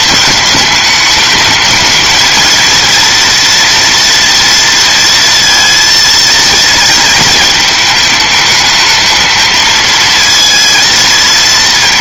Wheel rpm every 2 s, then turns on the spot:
220, 220, 230, 230, 220, 230.
none